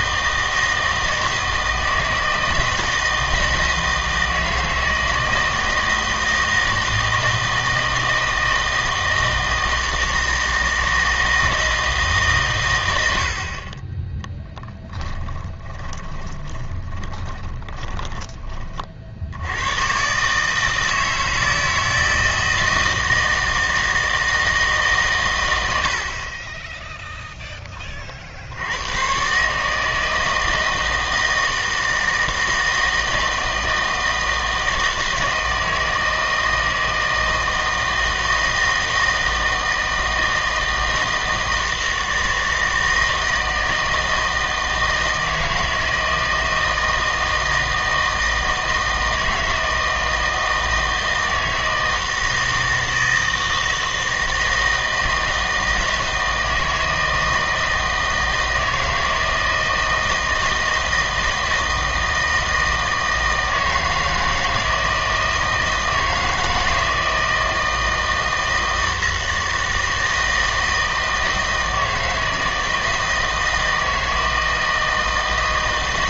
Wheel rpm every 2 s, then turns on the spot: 160, 160, 160, 160, 160, 160, 110, 10, 20, 30, 160, 160, 150, 20, 90, 160, 160, 160, 160, 160, 160, 160, 160, 160, 160, 160, 160, 160, 160, 160, 160, 160, 160, 160, 160, 160, 160, 160.
14-18